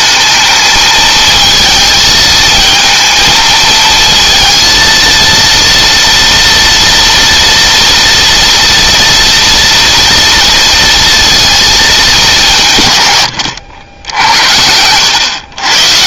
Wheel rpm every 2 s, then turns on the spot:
210, 220, 230, 230, 240, 230, 200, 90.
none